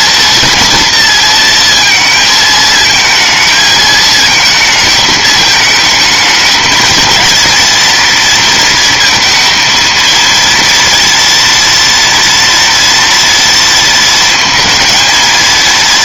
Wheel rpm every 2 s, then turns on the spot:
230, 220, 220, 230, 230, 230, 230, 230.
none